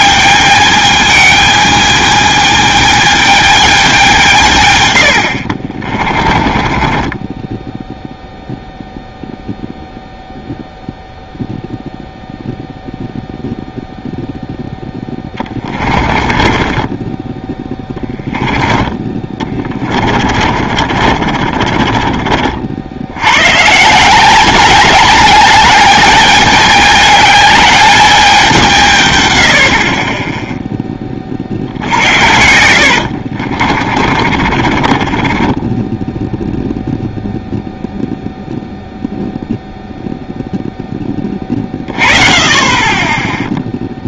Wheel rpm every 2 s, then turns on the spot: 220, 220, 150, 20, 0, 0, 0, 0, 20, 20, 50, 50, 200, 210, 190, 10, 70, 40, 0, 0, 0, 30.
6-8 16-18 20-22 32-36